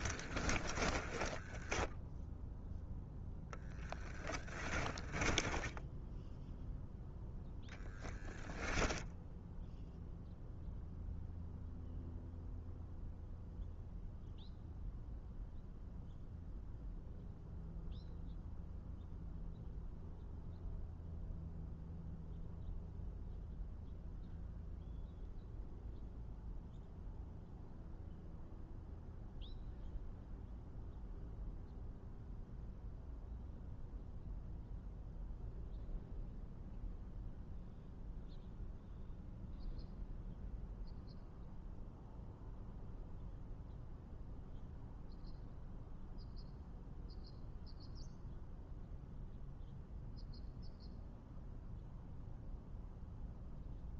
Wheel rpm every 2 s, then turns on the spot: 10, 0, 10, 0, 0, 0, 0, 0, 0, 0, 0, 0, 0, 0, 0, 0, 0, 0, 0, 0, 0, 0, 0, 0, 0, 0, 0.
0-2 4-6